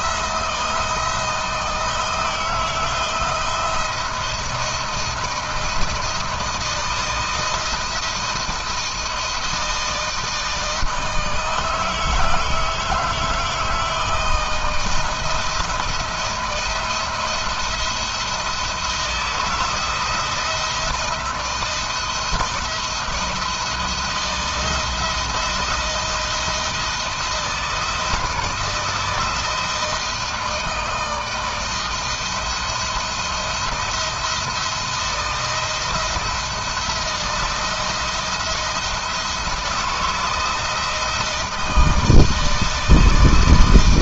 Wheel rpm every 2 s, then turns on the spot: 170, 160, 170, 160, 170, 160, 160, 170, 170, 170, 170, 170, 170, 160, 160, 160, 170, 170, 170, 160, 160, 160.
none